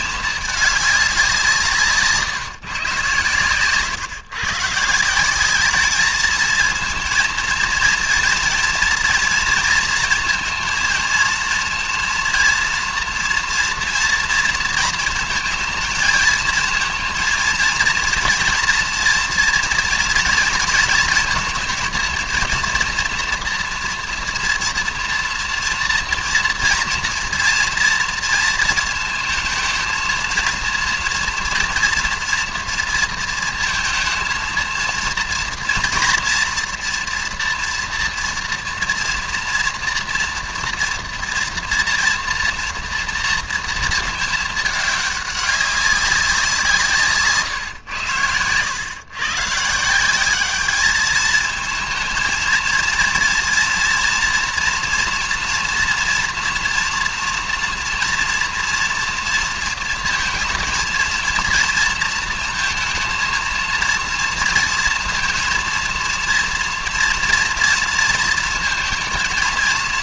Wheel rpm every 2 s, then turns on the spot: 210, 140, 150, 220, 230, 230, 230, 230, 220, 240, 230, 230, 230, 230, 230, 230, 230, 230, 230, 230, 230, 230, 210, 170, 100, 210, 230, 230, 230, 230, 230, 230, 230, 230, 230.
none